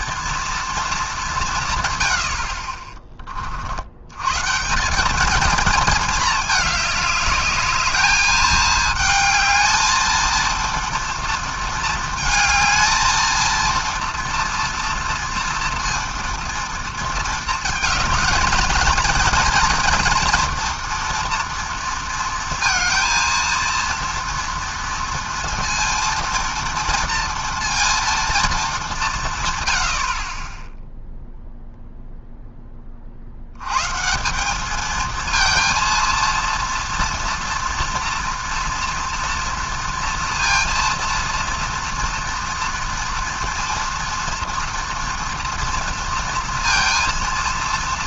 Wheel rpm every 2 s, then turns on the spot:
230, 50, 160, 210, 220, 230, 220, 230, 230, 220, 230, 230, 230, 230, 220, 20, 10, 200, 230, 230, 230, 230, 230, 230.
none